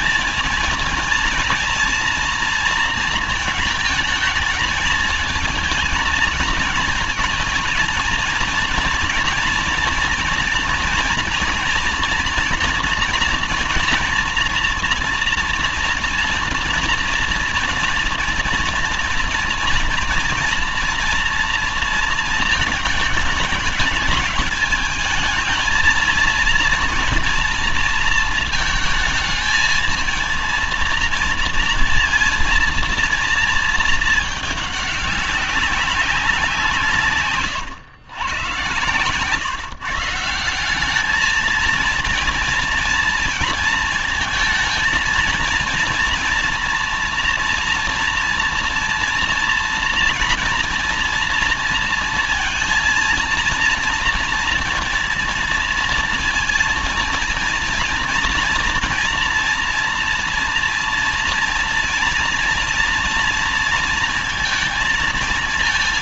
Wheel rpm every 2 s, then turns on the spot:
230, 230, 220, 220, 230, 230, 240, 230, 240, 240, 230, 210, 220, 230, 220, 230, 230, 200, 160, 120, 200, 230, 230, 230, 230, 230, 230, 230, 220, 230, 230, 230, 230.
36-38